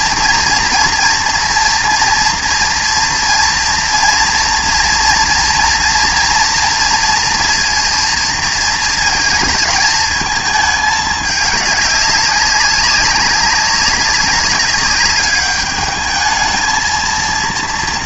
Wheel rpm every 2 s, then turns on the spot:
240, 230, 230, 230, 220, 210, 200, 200, 220.
none